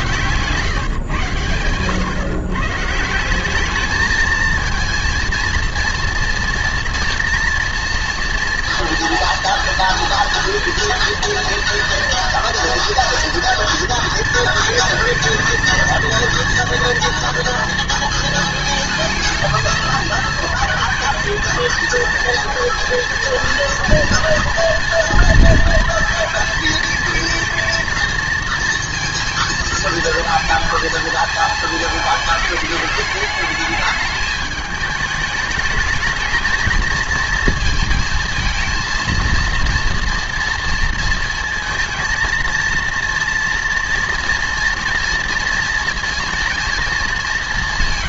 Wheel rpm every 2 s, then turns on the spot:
140, 140, 220, 240, 230, 230, 240, 230, 240, 220, 220, 230, 230, 230, 230, 230, 220, 220, 220, 230, 230, 230, 230, 230.
none